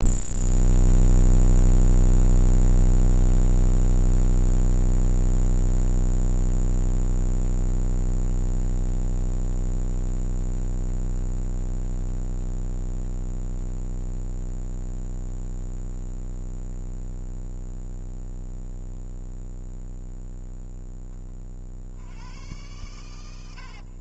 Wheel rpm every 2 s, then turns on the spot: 0, 0, 0, 0, 0, 0, 0, 0, 0, 0, 10, 100.
none